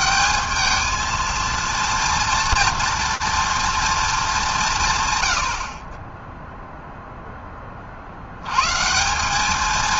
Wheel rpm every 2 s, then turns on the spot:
220, 240, 180, 0, 110.
none